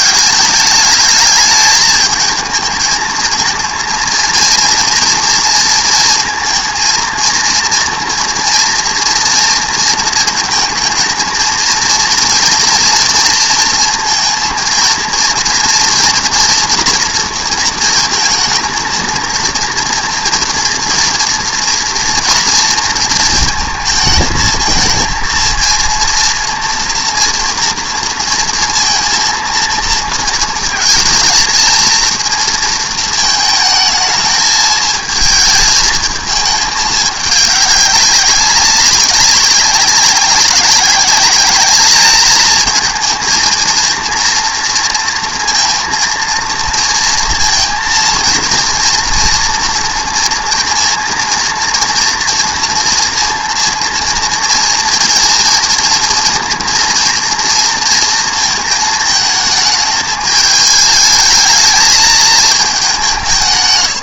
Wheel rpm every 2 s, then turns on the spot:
210, 220, 230, 220, 230, 220, 230, 230, 230, 230, 230, 230, 230, 230, 230, 230, 220, 220, 210, 200, 200, 220, 230, 230, 230, 230, 230, 230, 230, 220, 210, 200.
none